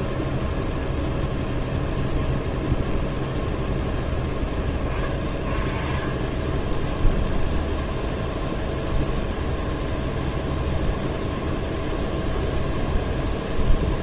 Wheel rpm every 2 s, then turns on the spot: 0, 0, 10, 10, 0, 0, 0.
none